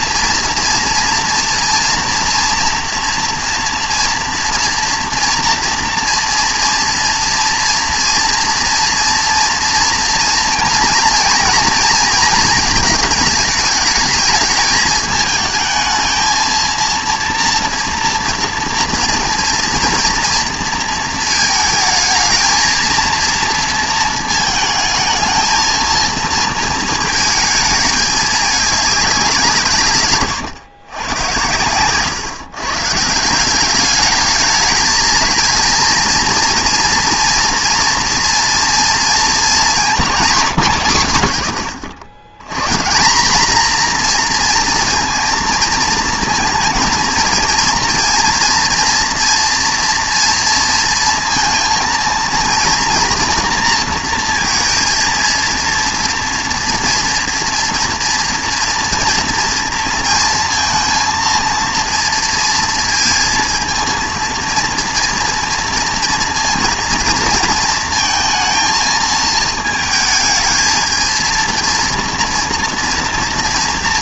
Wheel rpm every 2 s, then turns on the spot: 230, 240, 230, 230, 230, 230, 220, 210, 230, 230, 230, 220, 220, 220, 210, 120, 140, 210, 230, 230, 160, 120, 230, 230, 230, 230, 230, 230, 230, 230, 230, 230, 230, 230, 220, 220, 230.
none